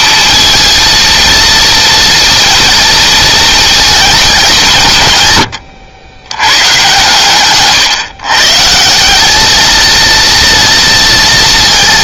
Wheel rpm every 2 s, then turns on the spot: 230, 230, 120, 130, 180, 230.
none